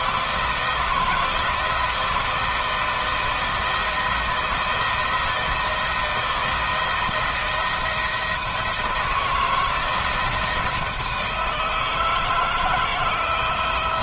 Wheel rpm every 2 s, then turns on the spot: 160, 160, 170, 170, 160, 170, 160.
none